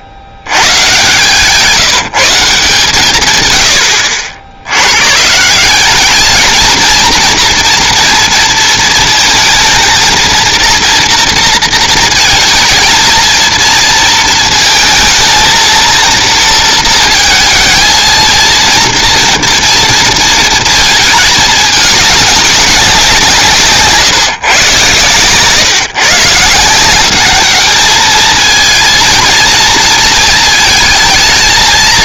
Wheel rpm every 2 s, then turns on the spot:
70, 170, 90, 230, 230, 240, 220, 230, 230, 230, 220, 190, 130, 170, 230, 220.
none